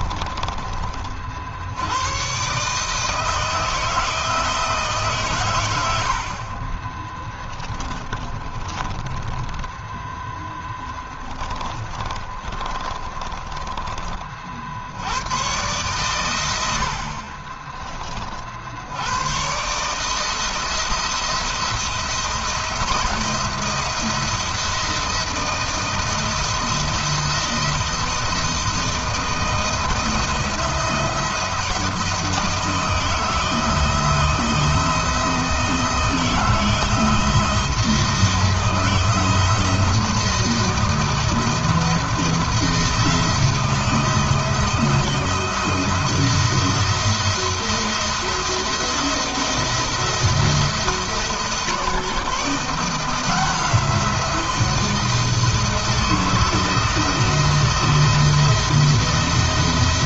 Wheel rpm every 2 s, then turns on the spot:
50, 160, 140, 10, 20, 10, 20, 90, 50, 90, 160, 170, 170, 170, 170, 170, 160, 170, 160, 160, 170, 170, 170, 160, 160, 160, 170, 170, 170, 170.
6-8 10-14 16-18